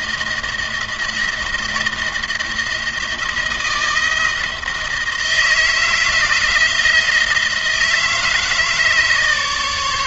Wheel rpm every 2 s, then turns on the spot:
170, 170, 160, 160, 160.
none